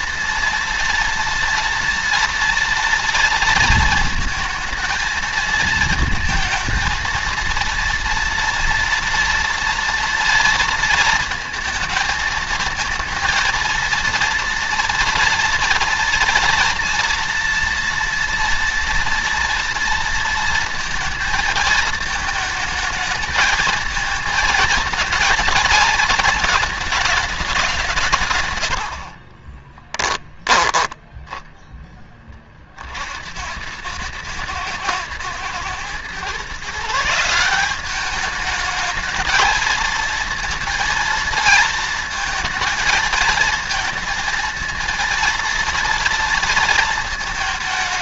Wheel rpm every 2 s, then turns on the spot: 230, 230, 220, 220, 230, 230, 220, 230, 230, 240, 230, 220, 230, 220, 110, 20, 40, 110, 150, 220, 230, 230, 230, 230.
30-32